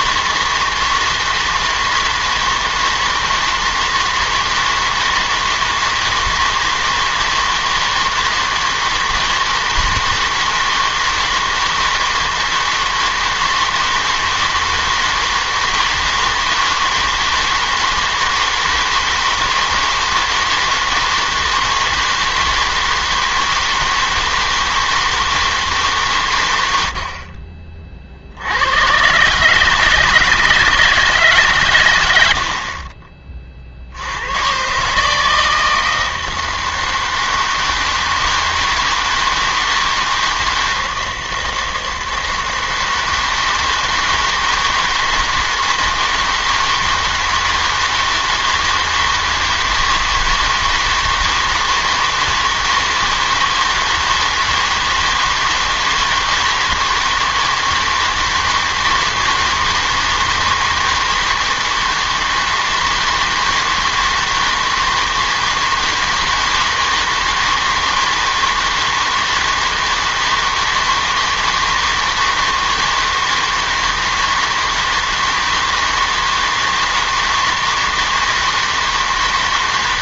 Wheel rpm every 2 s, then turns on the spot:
160, 160, 160, 160, 160, 160, 160, 160, 160, 160, 160, 160, 160, 100, 100, 160, 60, 130, 160, 160, 160, 160, 160, 160, 160, 160, 160, 160, 160, 160, 160, 160, 160, 160, 160, 160, 160, 160, 160, 160.
none